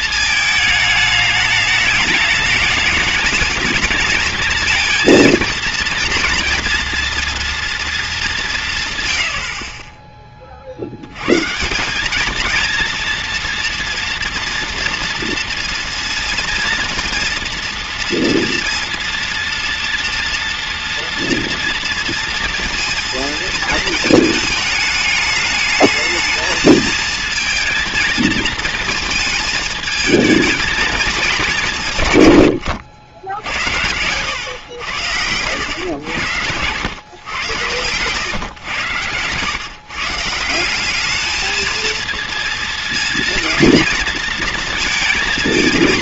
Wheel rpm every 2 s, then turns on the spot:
220, 220, 230, 240, 140, 30, 230, 230, 230, 230, 240, 230, 210, 220, 230, 220, 100, 100, 110, 120, 180, 230, 230.
none